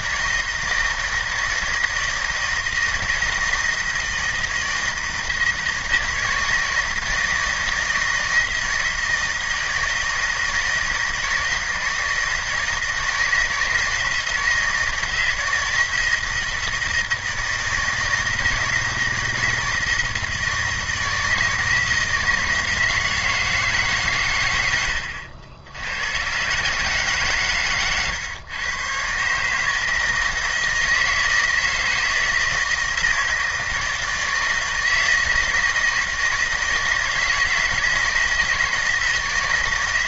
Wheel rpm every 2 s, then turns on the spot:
160, 160, 160, 160, 160, 160, 160, 170, 160, 160, 160, 170, 100, 140, 120, 160, 160, 160, 160, 160.
none